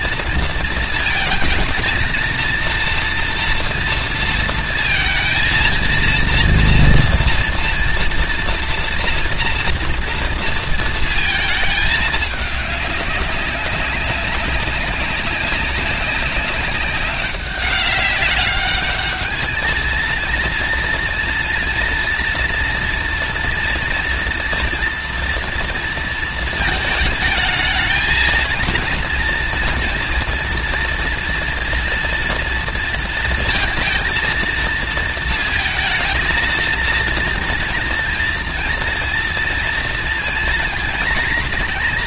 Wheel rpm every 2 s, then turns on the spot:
230, 230, 230, 230, 230, 230, 210, 200, 200, 200, 230, 230, 240, 220, 230, 240, 230, 230, 230, 230, 230.
none